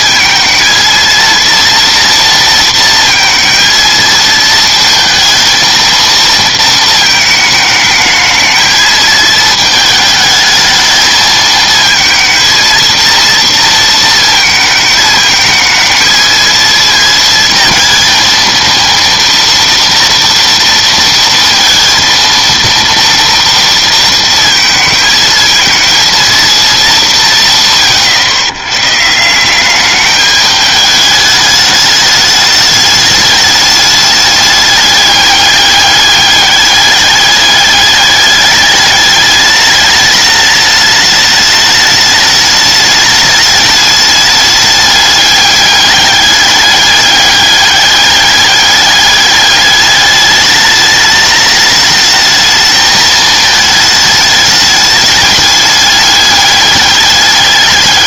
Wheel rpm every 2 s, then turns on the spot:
230, 230, 230, 230, 220, 220, 220, 220, 220, 230, 230, 230, 230, 230, 110, 210, 210, 210, 200, 210, 210, 210, 210, 210, 200, 210, 220, 210, 200.
none